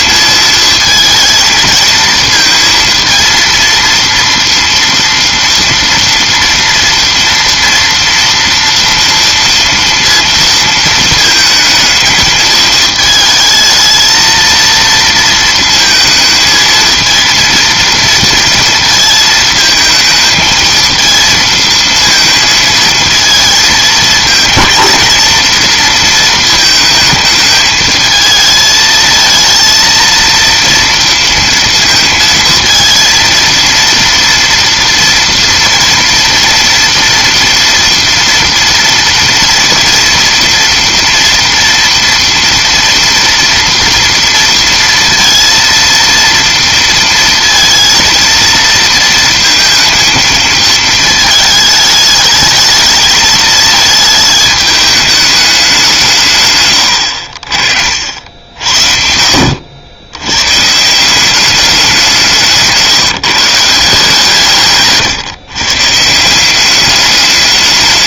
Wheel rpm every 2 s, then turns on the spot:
220, 230, 230, 230, 230, 230, 220, 230, 220, 230, 220, 230, 220, 220, 220, 230, 220, 230, 240, 230, 230, 240, 230, 230, 230, 220, 220, 210, 120, 70, 140, 160, 140, 200.
62-64